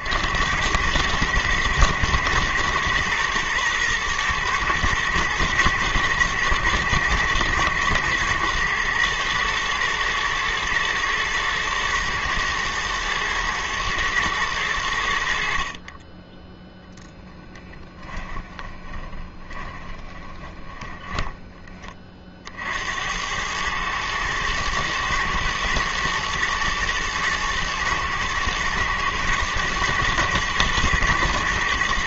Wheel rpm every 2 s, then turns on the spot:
90, 110, 110, 110, 120, 120, 110, 100, 0, 10, 20, 50, 110, 110, 110, 120.
18-22